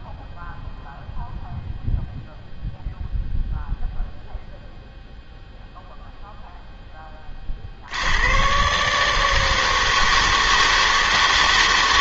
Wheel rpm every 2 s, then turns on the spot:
0, 0, 0, 10, 140, 160.
none